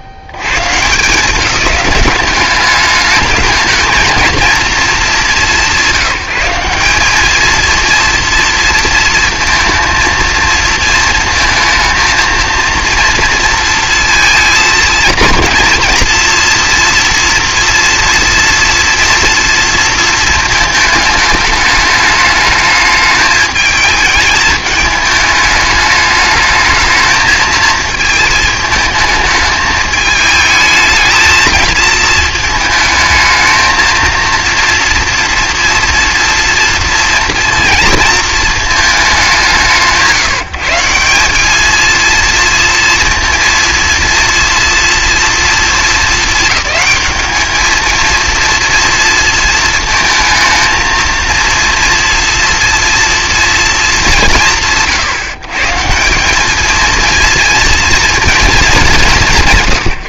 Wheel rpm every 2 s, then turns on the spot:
130, 210, 230, 180, 230, 230, 230, 230, 230, 240, 220, 210, 210, 220, 220, 220, 220, 230, 230, 220, 170, 230, 240, 210, 230, 220, 230, 150, 220, 220.
none